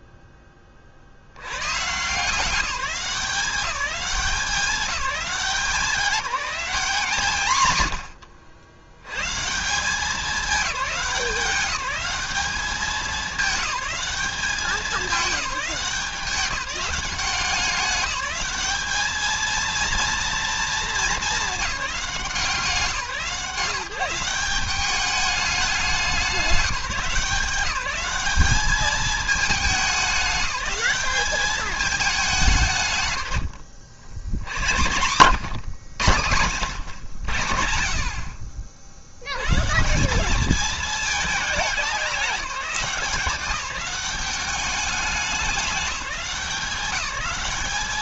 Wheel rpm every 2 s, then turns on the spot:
20, 180, 200, 170, 70, 200, 200, 210, 200, 200, 230, 170, 190, 190, 200, 190, 160, 100, 110, 70, 210, 180, 190, 200.
none